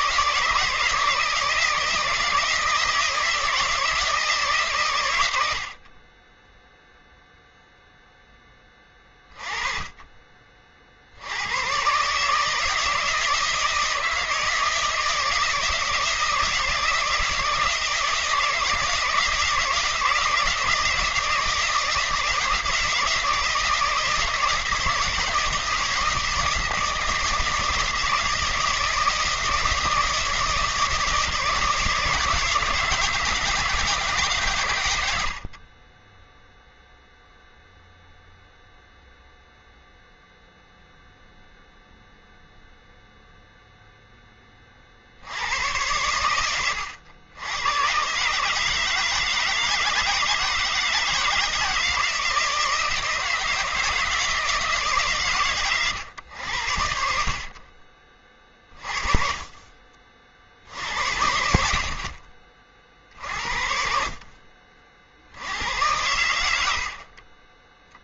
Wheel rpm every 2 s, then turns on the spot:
160, 160, 140, 0, 20, 50, 160, 160, 160, 160, 160, 160, 160, 160, 160, 160, 160, 120, 0, 0, 0, 0, 30, 100, 150, 160, 160, 160, 80, 30, 70, 50, 40, 80.
none